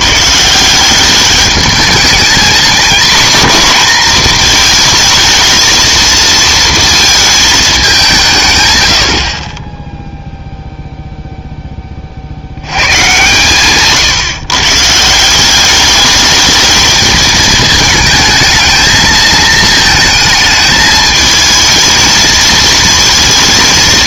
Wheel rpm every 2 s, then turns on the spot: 170, 240, 230, 230, 130, 0, 90, 140, 210, 220, 220, 220.
none